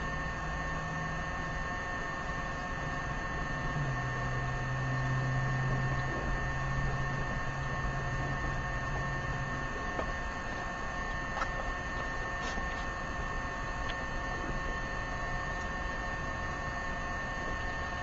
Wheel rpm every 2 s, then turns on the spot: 0, 0, 0, 0, 0, 0, 0, 0, 0.
none